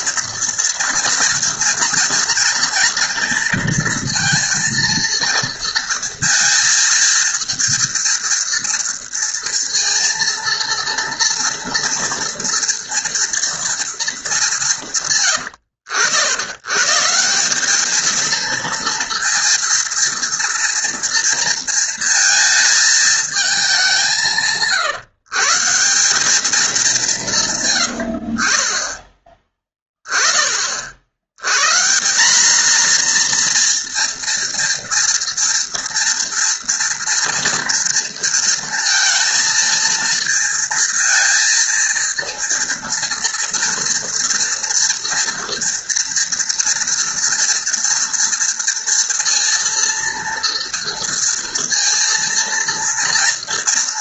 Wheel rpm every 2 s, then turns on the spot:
230, 230, 230, 230, 230, 230, 230, 140, 140, 230, 230, 220, 140, 200, 20, 50, 230, 230, 230, 230, 230, 230, 230, 240, 230, 230, 230.
none